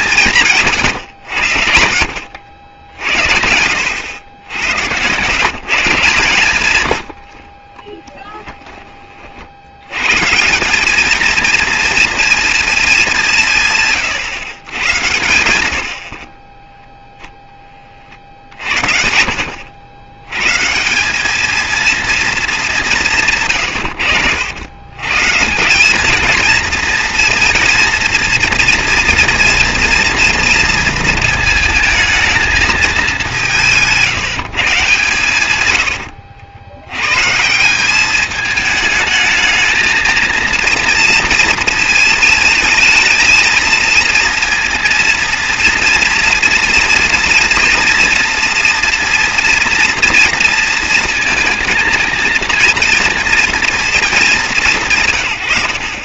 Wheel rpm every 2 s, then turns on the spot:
130, 80, 110, 110, 20, 190, 220, 100, 10, 70, 150, 210, 110, 230, 240, 230, 220, 140, 100, 220, 230, 220, 230, 240, 240, 230, 230, 160.
8-10